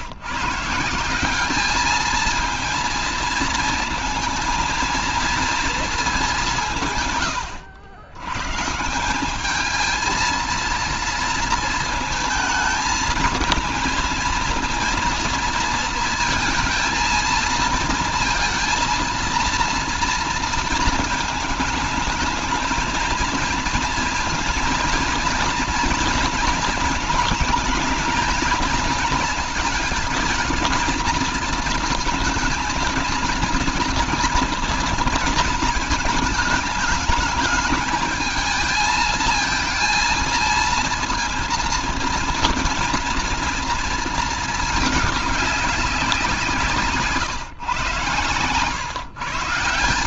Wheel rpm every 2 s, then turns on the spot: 160, 230, 230, 170, 140, 230, 220, 230, 220, 230, 220, 220, 230, 220, 230, 230, 230, 230, 210, 220, 230, 230, 210, 160, 120.
46-48